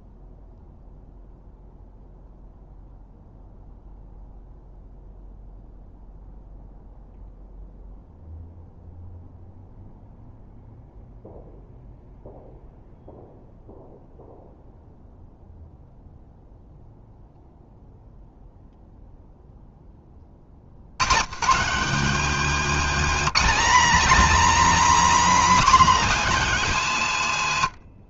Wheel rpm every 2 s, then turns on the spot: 0, 0, 0, 0, 0, 0, 0, 0, 0, 0, 50, 240, 290, 260.
none